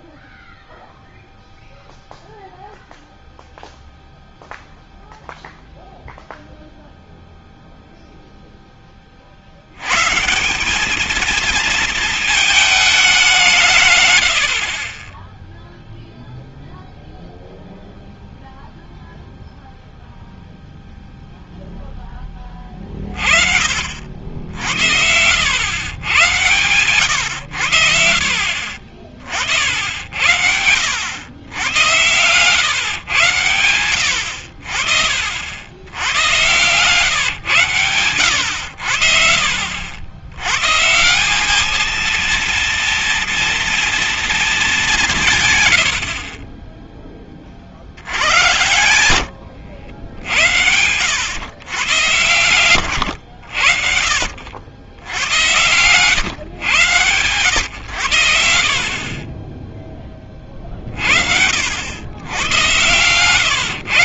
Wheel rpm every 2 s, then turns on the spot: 0, 0, 0, 0, 10, 180, 220, 60, 0, 0, 0, 30, 60, 120, 60, 90, 110, 60, 120, 80, 120, 230, 220, 30, 90, 80, 100, 70, 110, 80, 40, 100.
none